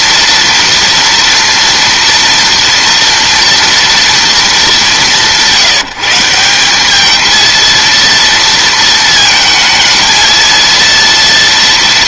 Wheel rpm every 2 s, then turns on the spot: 230, 230, 210, 190, 230, 230.
none